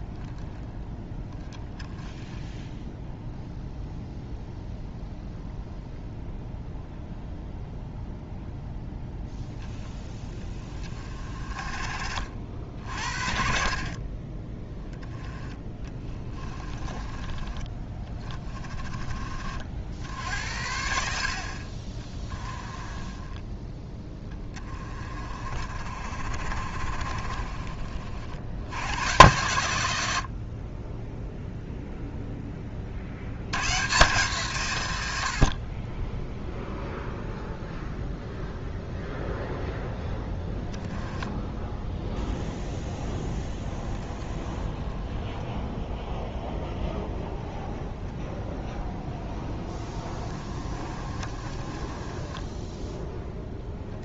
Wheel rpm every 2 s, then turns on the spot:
10, 0, 0, 0, 0, 20, 50, 10, 20, 30, 70, 30, 20, 30, 100, 20, 50, 100, 0, 0, 10, 0, 10, 0, 0, 30, 10.
none